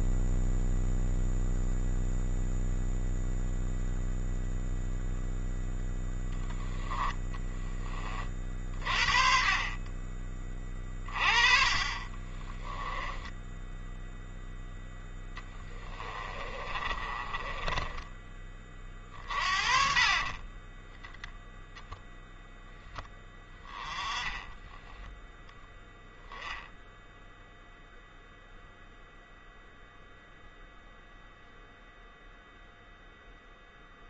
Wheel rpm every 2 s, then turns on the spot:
0, 0, 0, 10, 40, 30, 10, 10, 30, 40, 0, 10, 0, 0, 0, 0, 0.
14-20